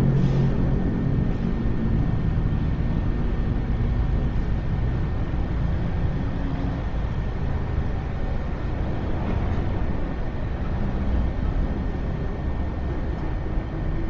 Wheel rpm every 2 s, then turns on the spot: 0, 0, 0, 0, 0, 0, 0.
none